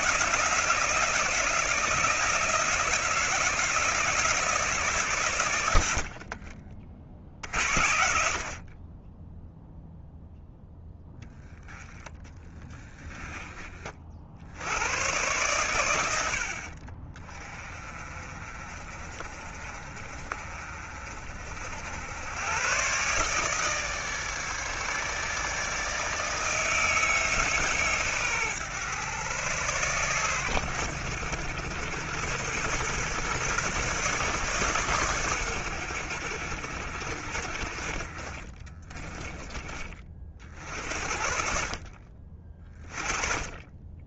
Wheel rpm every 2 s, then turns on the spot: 170, 160, 140, 50, 30, 10, 20, 100, 40, 40, 40, 130, 150, 150, 110, 90, 120, 120, 70, 30, 60, 30.
12-14 38-40